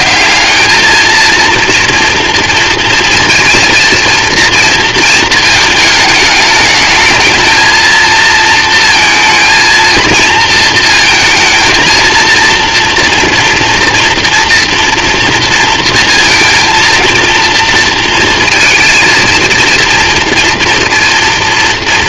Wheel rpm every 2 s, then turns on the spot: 210, 230, 220, 220, 230, 230, 230, 230, 230, 230, 230.
none